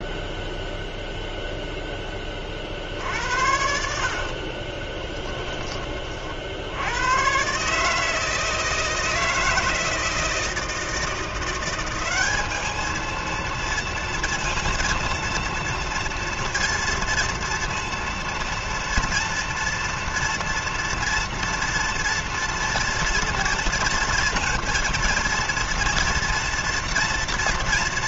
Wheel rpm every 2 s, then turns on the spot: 0, 50, 30, 90, 160, 160, 220, 230, 230, 230, 230, 230, 230, 230.
4-6